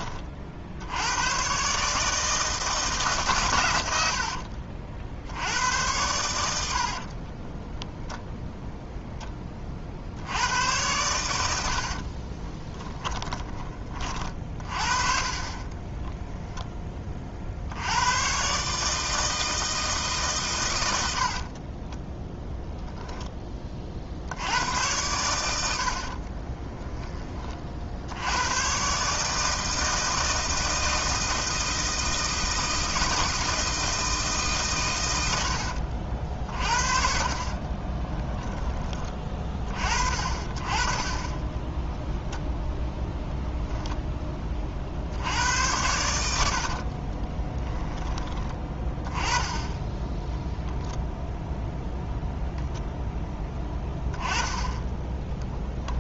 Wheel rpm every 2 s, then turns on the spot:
70, 160, 50, 70, 0, 100, 20, 40, 10, 140, 110, 0, 90, 20, 120, 160, 160, 130, 50, 20, 40, 0, 40, 70, 20, 0, 0, 10.
12-14 26-28 46-48